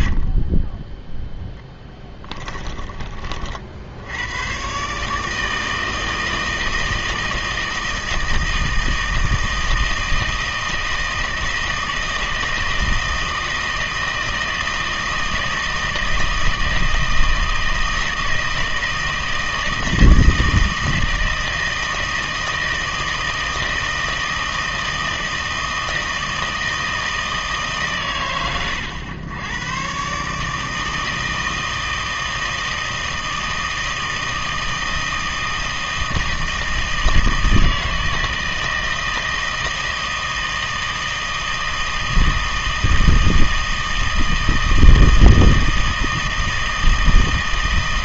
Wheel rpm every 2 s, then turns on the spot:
10, 20, 130, 160, 160, 160, 160, 160, 160, 160, 160, 160, 160, 160, 110, 160, 160, 160, 160, 160, 160, 160, 160, 160.
0-4